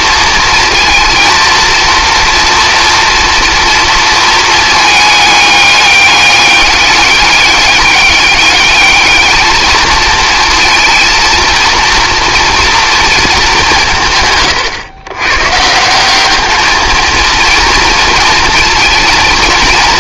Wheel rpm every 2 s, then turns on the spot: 220, 230, 220, 200, 220, 230, 230, 120, 220, 220.
none